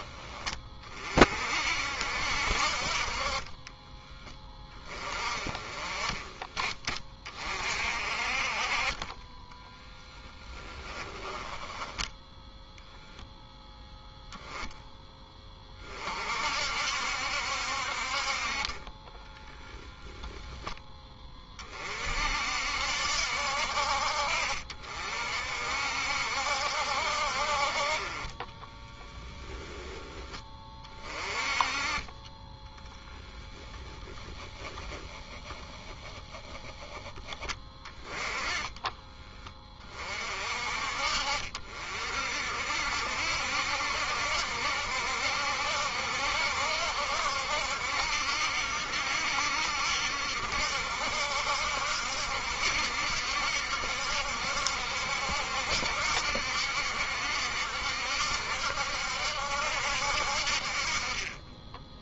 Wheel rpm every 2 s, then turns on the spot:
30, 40, 20, 40, 30, 10, 0, 10, 60, 30, 20, 70, 50, 60, 20, 30, 10, 10, 10, 20, 50, 60, 70, 70, 70, 60, 70, 70, 70, 70, 40.
10-12 18-20 28-30 32-34